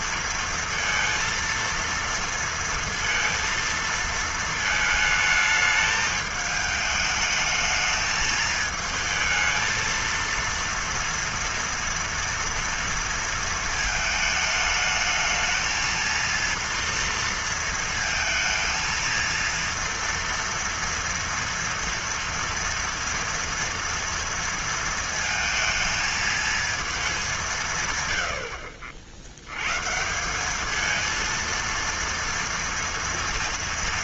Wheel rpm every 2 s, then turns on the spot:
230, 230, 230, 220, 220, 230, 230, 220, 230, 220, 230, 230, 230, 220, 80, 190, 230.
none